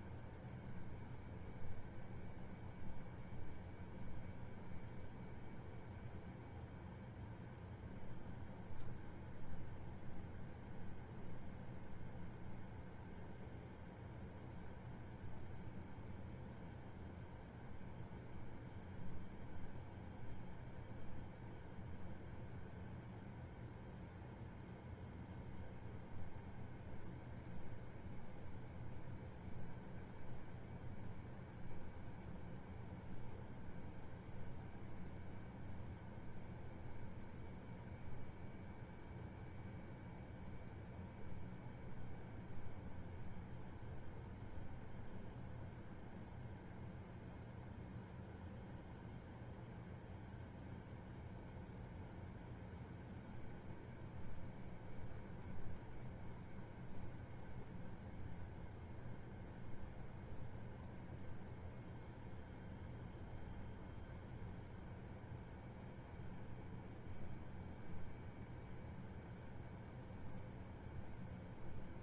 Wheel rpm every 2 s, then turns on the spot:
0, 0, 0, 0, 0, 0, 0, 0, 0, 0, 0, 0, 0, 0, 0, 0, 0, 0, 0, 0, 0, 0, 0, 0, 0, 0, 0, 0, 0, 0, 0, 0, 0, 0, 0, 0.
none